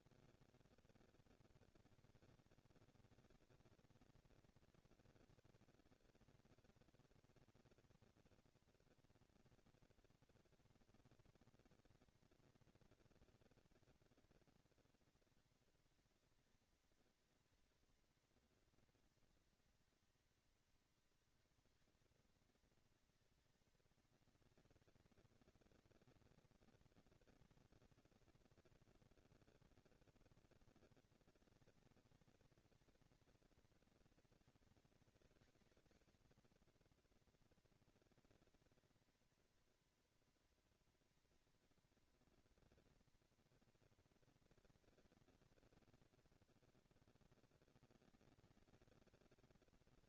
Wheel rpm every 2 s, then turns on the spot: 200, 210, 230, 230, 230, 230, 230, 220, 210, 220, 220, 220, 220, 230, 230, 220, 230, 240, 240, 220, 230, 230, 230, 220, 220.
none